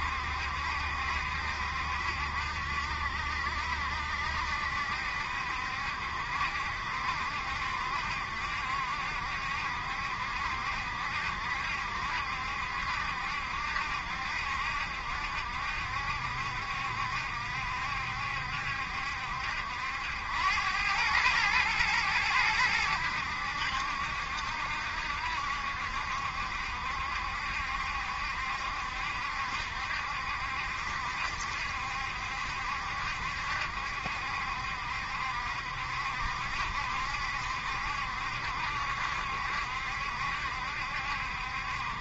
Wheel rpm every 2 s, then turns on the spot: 70, 70, 70, 70, 70, 70, 70, 70, 70, 70, 100, 100, 70, 70, 70, 70, 70, 70, 70, 70, 70.
none